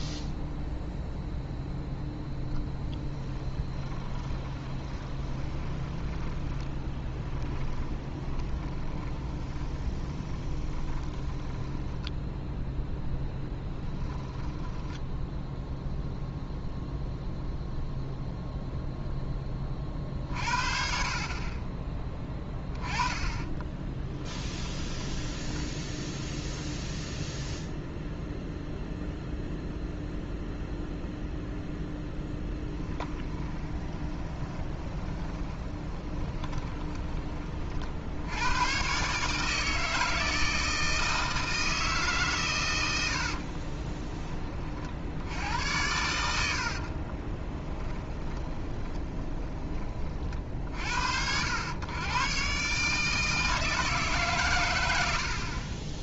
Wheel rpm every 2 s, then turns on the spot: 0, 10, 30, 10, 20, 20, 0, 10, 0, 0, 60, 10, 10, 0, 0, 0, 10, 20, 20, 110, 160, 110, 40, 70, 30, 60, 140, 100.
2-12 14-16 24-26 32-38 46-50